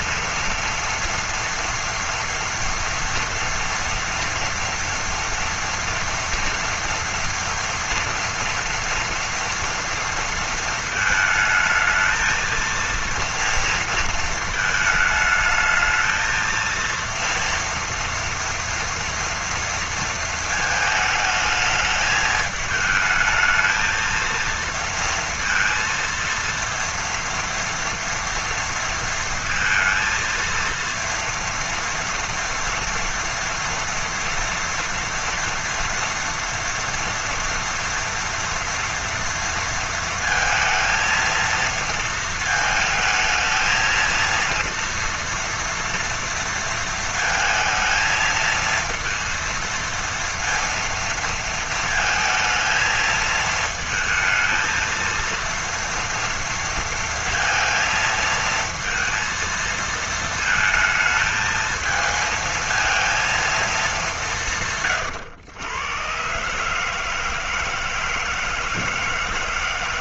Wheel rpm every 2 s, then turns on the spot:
230, 230, 240, 230, 230, 220, 230, 220, 230, 230, 220, 210, 230, 230, 230, 230, 230, 230, 230, 230, 230, 220, 230, 230, 230, 230, 230, 230, 230, 230, 220, 230, 130, 150, 160.
none